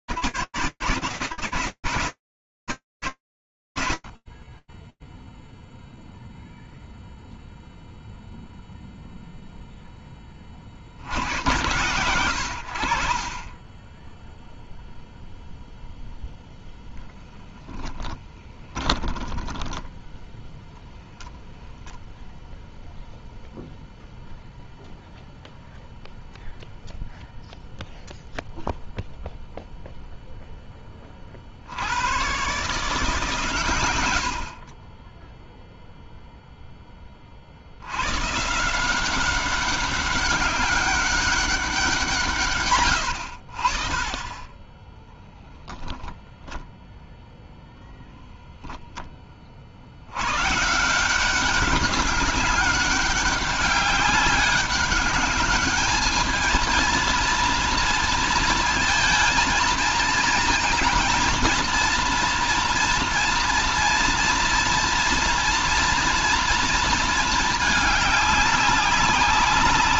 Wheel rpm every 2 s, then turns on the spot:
0, 0, 0, 10, 100, 10, 0, 20, 10, 10, 0, 0, 0, 0, 20, 150, 40, 10, 160, 200, 130, 20, 0, 0, 120, 200, 200, 220, 230, 220, 230, 230, 230, 200, 100.
14-18